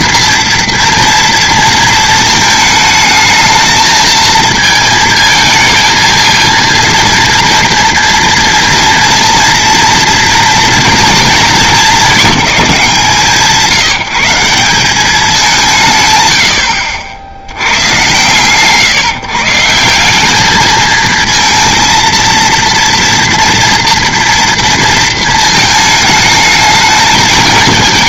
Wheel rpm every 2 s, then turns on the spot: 230, 220, 220, 230, 230, 230, 200, 180, 100, 130, 210, 230, 230, 220.
none